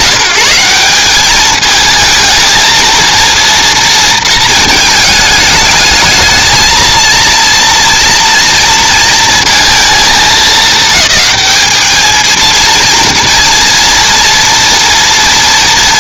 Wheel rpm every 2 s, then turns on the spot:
190, 230, 220, 220, 230, 220, 220, 230.
none